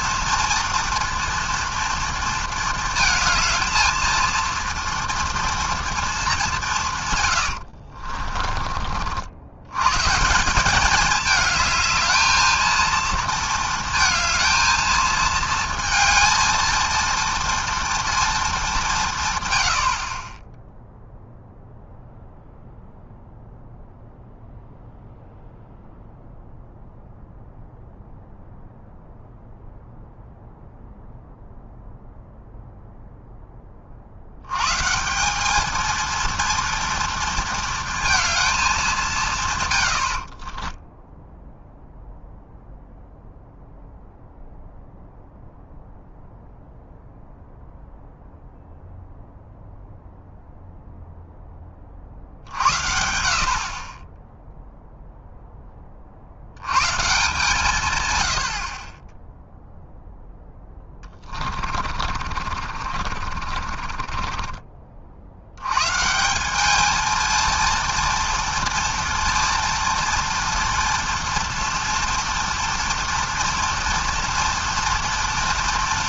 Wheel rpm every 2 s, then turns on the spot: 230, 230, 230, 200, 40, 190, 220, 220, 220, 210, 10, 0, 0, 0, 0, 0, 0, 110, 230, 220, 30, 0, 0, 0, 0, 0, 60, 0, 70, 90, 10, 40, 30, 200, 230, 230, 230, 240.
8-10 40-42 60-66